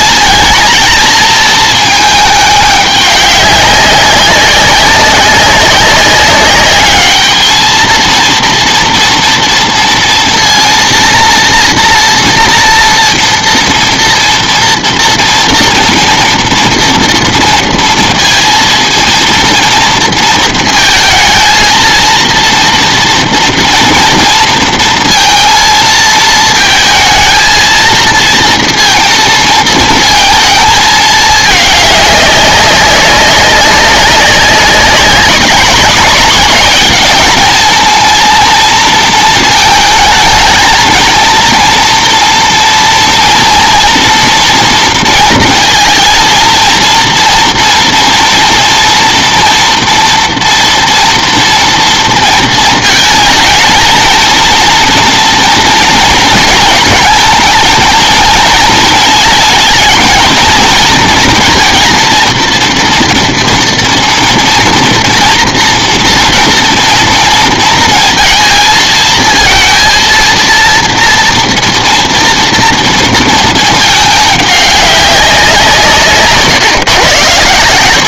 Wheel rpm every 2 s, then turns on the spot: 220, 200, 190, 210, 230, 230, 230, 240, 230, 230, 220, 230, 230, 220, 230, 220, 190, 190, 210, 230, 220, 230, 230, 230, 230, 230, 220, 230, 230, 220, 230, 230, 230, 230, 220, 230, 230, 200, 120.
none